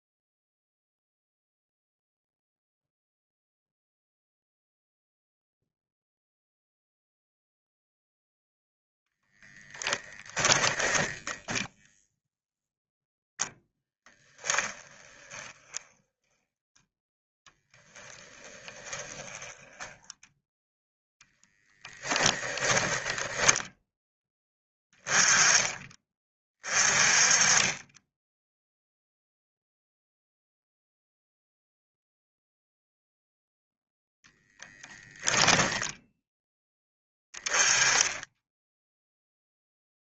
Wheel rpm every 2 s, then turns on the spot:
0, 0, 0, 0, 0, 10, 0, 20, 10, 20, 0, 10, 10, 30, 0, 0, 0, 10, 10, 0.
10-12 14-20 22-24